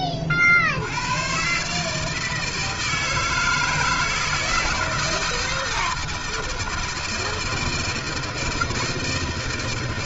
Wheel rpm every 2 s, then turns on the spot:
50, 160, 160, 160, 160.
none